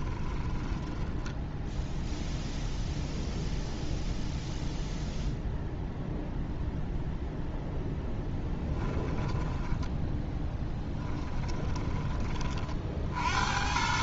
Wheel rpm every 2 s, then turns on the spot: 10, 0, 0, 0, 10, 10, 50.
0-2 8-12